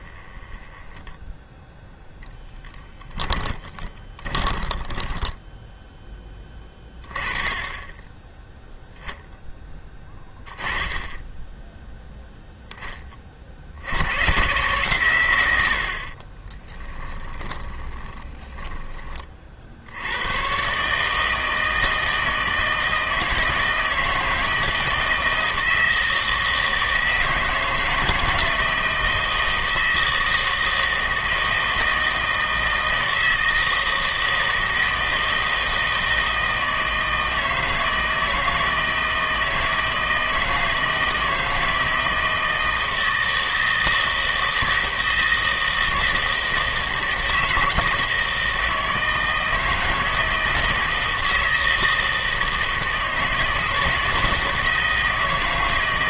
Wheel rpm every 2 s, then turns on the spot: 10, 10, 20, 20, 10, 10, 0, 140, 20, 20, 130, 160, 160, 160, 160, 160, 160, 160, 160, 160, 160, 160, 160, 160, 160, 160, 160, 160.
0-6 16-20